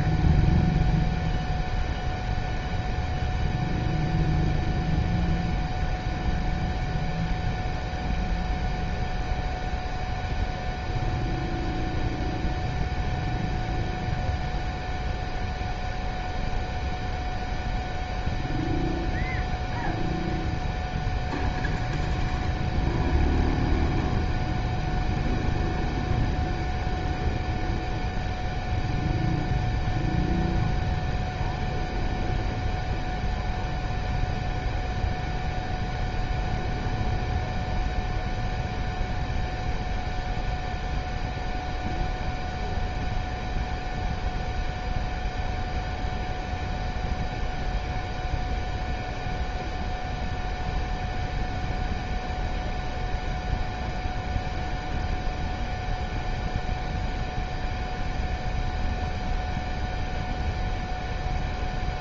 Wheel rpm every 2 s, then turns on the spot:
0, 0, 0, 0, 0, 0, 0, 0, 0, 0, 0, 0, 0, 0, 0, 0, 0, 0, 0, 0, 0, 0, 0, 0, 0, 0, 0, 0, 0, 0, 0.
none